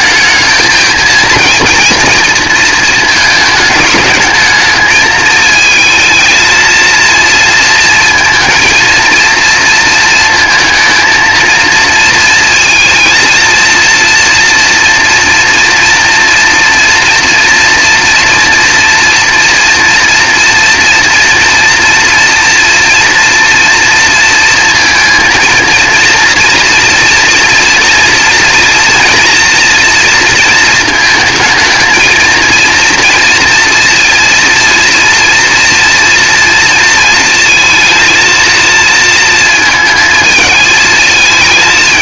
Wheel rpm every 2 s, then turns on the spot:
220, 220, 220, 230, 230, 230, 230, 240, 230, 230, 230, 230, 230, 230, 230, 220, 230, 230, 230, 230, 220.
none